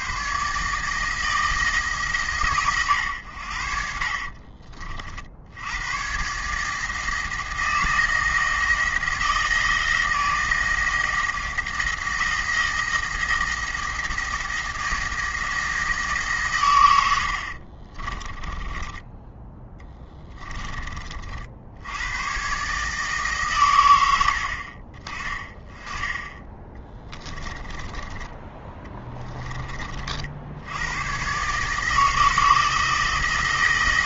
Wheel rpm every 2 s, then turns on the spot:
150, 120, 50, 160, 170, 160, 170, 160, 130, 20, 30, 150, 50, 20, 20, 90, 160.
18-20 26-30